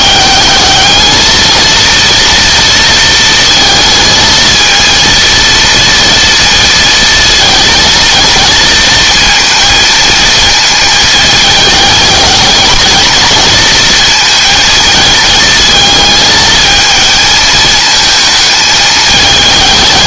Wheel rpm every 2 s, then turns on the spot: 210, 230, 220, 230, 230, 220, 220, 230, 220, 220.
none